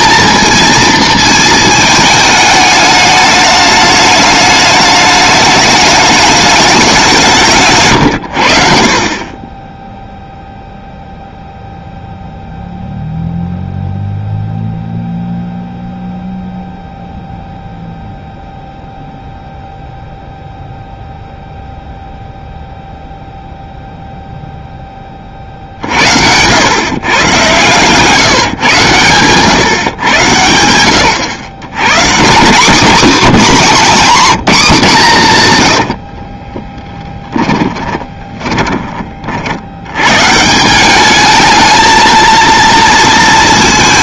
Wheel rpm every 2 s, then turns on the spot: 230, 210, 210, 200, 50, 0, 0, 0, 0, 0, 0, 0, 0, 110, 120, 100, 220, 210, 20, 20, 180, 230.
36-38